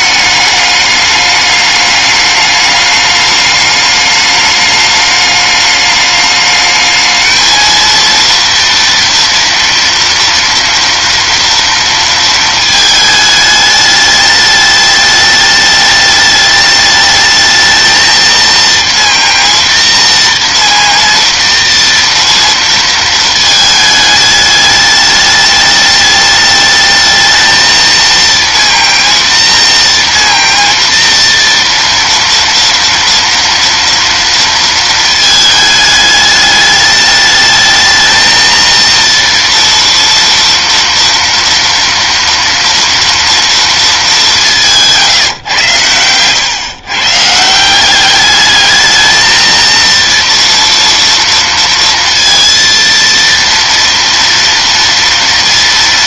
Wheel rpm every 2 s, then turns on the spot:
210, 210, 210, 210, 230, 230, 220, 210, 210, 230, 230, 230, 210, 210, 230, 230, 230, 230, 210, 220, 230, 230, 200, 120, 210, 230, 230, 230.
none